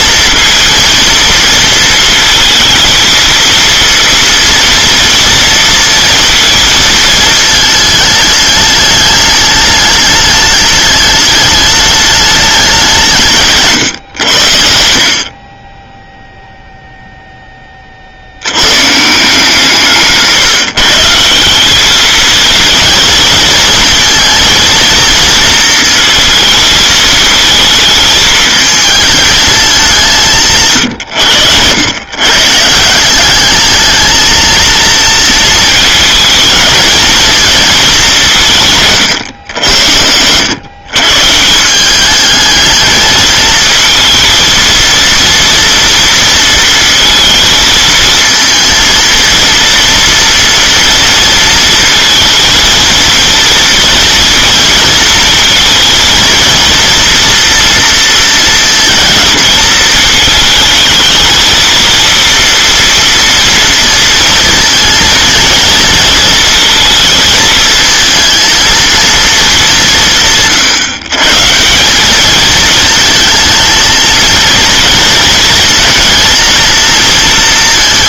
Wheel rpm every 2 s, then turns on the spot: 230, 230, 230, 230, 210, 210, 190, 80, 0, 100, 150, 220, 230, 220, 220, 160, 150, 230, 220, 160, 110, 220, 230, 230, 230, 230, 230, 230, 230, 230, 220, 230, 230, 230, 220, 150, 220, 230, 220.
none